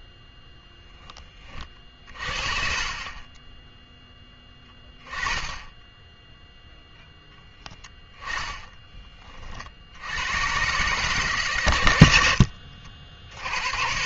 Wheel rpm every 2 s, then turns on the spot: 40, 0, 10, 10, 40, 120, 80.
none